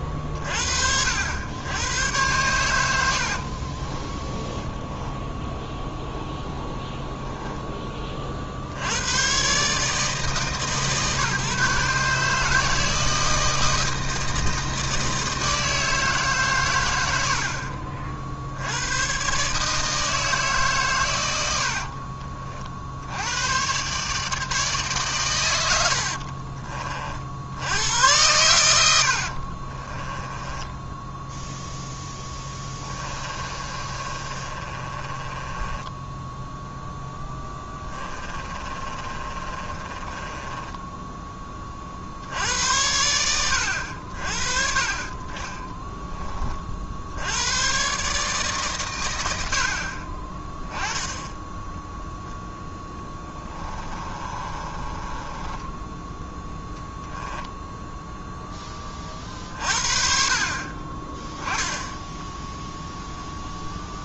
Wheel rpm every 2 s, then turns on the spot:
30, 100, 10, 0, 40, 150, 160, 160, 110, 80, 130, 60, 140, 40, 100, 10, 10, 30, 0, 30, 10, 80, 40, 40, 140, 10, 10, 30, 0, 20, 30, 0.
4-6 28-36 38-42 54-56